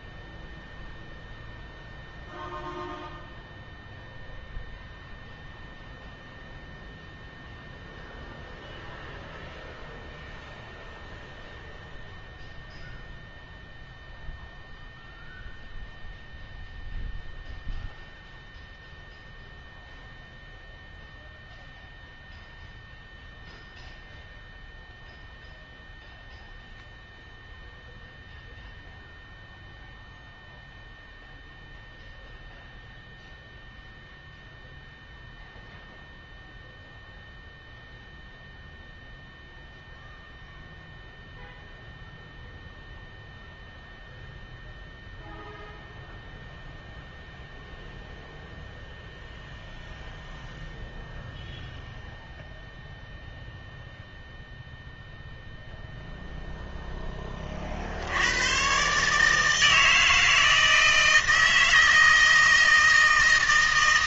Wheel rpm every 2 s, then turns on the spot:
0, 0, 0, 0, 0, 0, 0, 0, 0, 0, 0, 0, 0, 0, 0, 0, 0, 0, 0, 0, 0, 0, 0, 0, 0, 0, 0, 0, 0, 120, 160, 160.
none